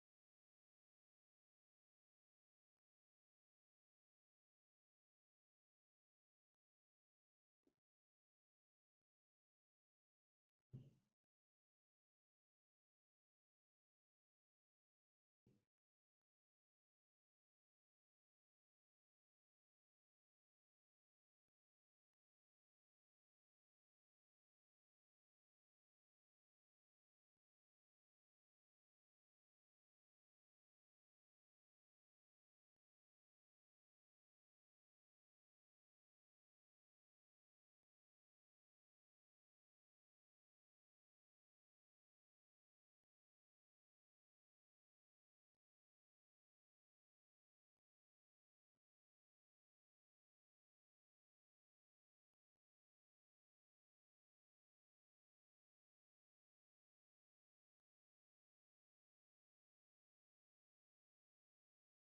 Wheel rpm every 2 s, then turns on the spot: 0, 0, 0, 0, 0, 0, 0, 0, 0, 0, 0, 0, 0, 0, 0, 0, 0, 0, 0, 0, 0, 0, 0, 0, 0, 0, 0, 0, 0, 0, 0.
none